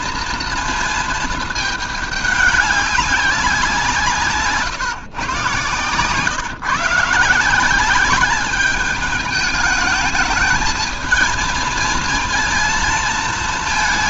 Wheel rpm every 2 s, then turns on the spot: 230, 200, 150, 140, 210, 220, 230.
none